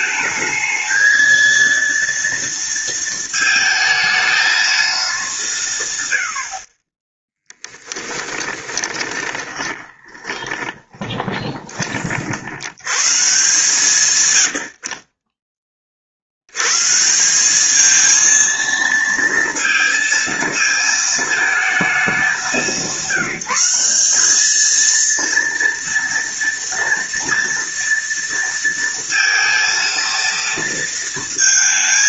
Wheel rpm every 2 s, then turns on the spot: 220, 230, 220, 50, 20, 20, 90, 70, 100, 230, 220, 200, 220, 230, 230, 230.
8-12